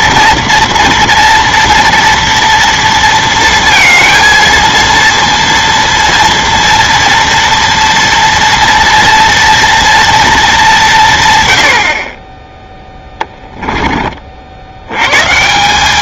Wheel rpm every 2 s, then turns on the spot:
230, 230, 230, 230, 230, 170, 10, 90.
12-14